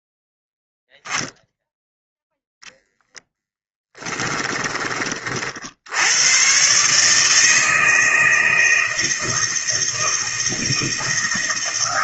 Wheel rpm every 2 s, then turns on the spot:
0, 10, 30, 150, 160, 160.
none